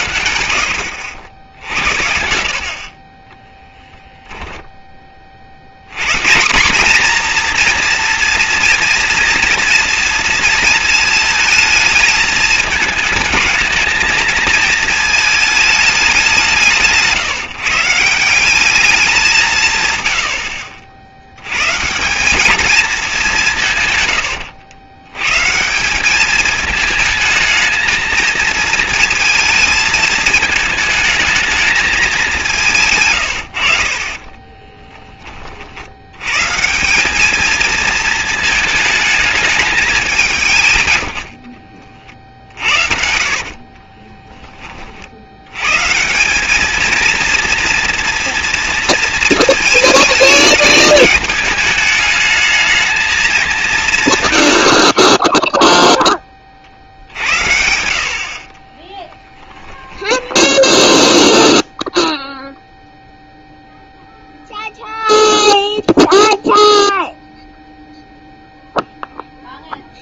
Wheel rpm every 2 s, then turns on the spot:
80, 60, 10, 210, 230, 230, 220, 220, 160, 200, 60, 210, 110, 220, 230, 220, 150, 20, 160, 220, 120, 50, 20, 210, 230, 220, 220, 70, 50, 30, 0, 0, 0, 0, 0.
2-6 32-36 42-44 58-60